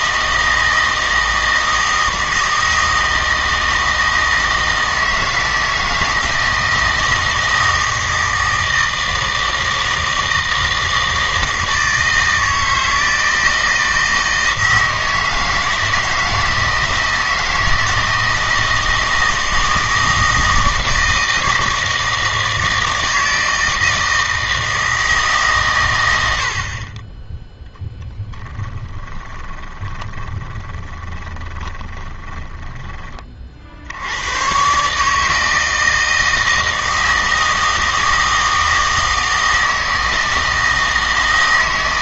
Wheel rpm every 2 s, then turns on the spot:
160, 160, 160, 160, 160, 160, 160, 160, 160, 160, 160, 160, 160, 50, 20, 20, 20, 140, 160, 160, 160.
28-34